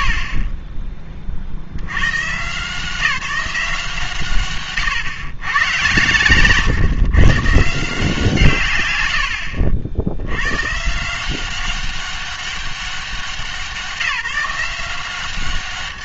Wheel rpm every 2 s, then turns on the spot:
60, 140, 130, 120, 150, 120, 190, 170.
none